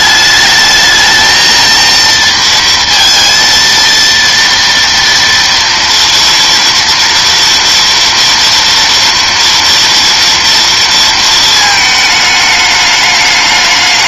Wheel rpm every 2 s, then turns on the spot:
220, 230, 230, 230, 230, 230, 210.
none